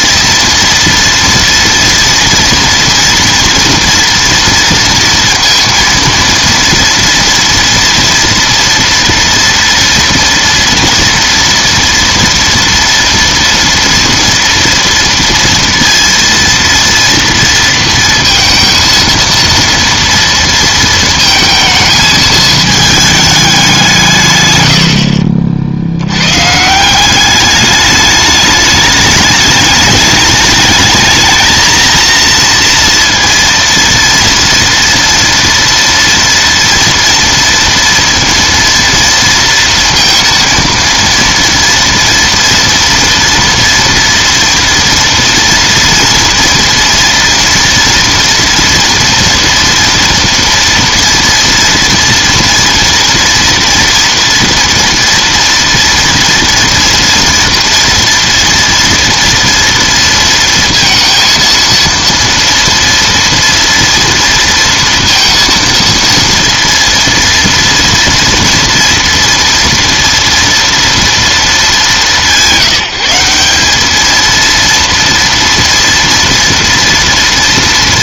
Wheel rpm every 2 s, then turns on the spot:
230, 230, 230, 230, 230, 230, 230, 230, 230, 230, 230, 220, 110, 150, 210, 210, 230, 230, 230, 230, 230, 230, 230, 230, 230, 240, 230, 240, 230, 230, 230, 230, 230, 230, 230, 230, 170, 230, 230.
none